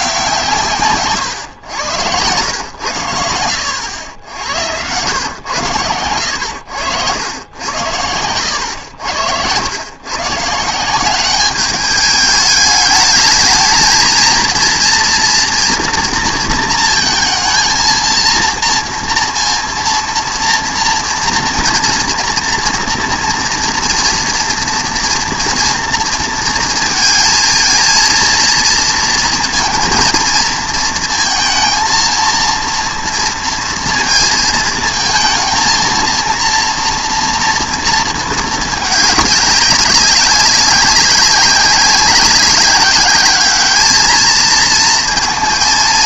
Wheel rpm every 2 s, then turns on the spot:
140, 100, 100, 90, 90, 170, 210, 240, 230, 230, 230, 230, 230, 230, 230, 230, 230, 220, 230, 210, 190, 200, 220.
none